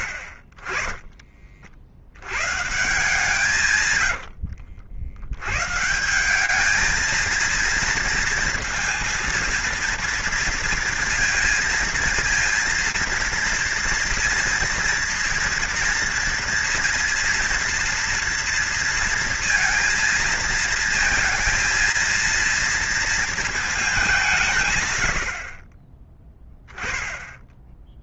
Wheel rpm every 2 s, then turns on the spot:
40, 150, 60, 220, 230, 230, 230, 230, 230, 230, 230, 230, 130, 10.
none